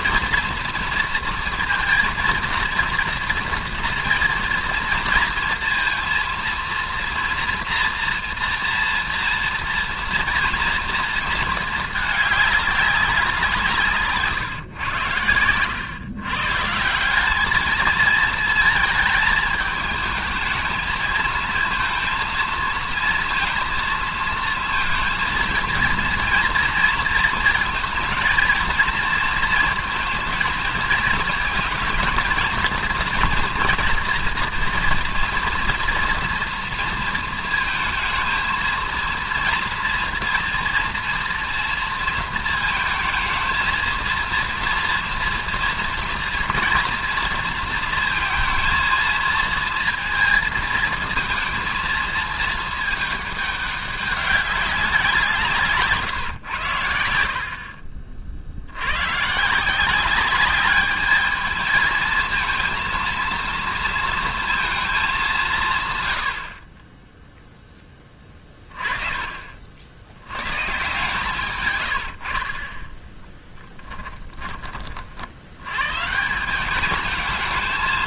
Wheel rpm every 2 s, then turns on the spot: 240, 230, 230, 230, 230, 230, 210, 130, 150, 220, 220, 230, 230, 230, 230, 230, 220, 230, 230, 230, 230, 220, 230, 230, 220, 230, 220, 200, 110, 70, 200, 230, 230, 60, 30, 120, 30, 30, 190.
66-68